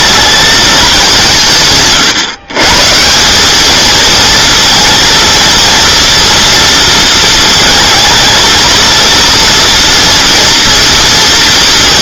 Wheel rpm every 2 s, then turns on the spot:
210, 140, 230, 230, 230, 230.
none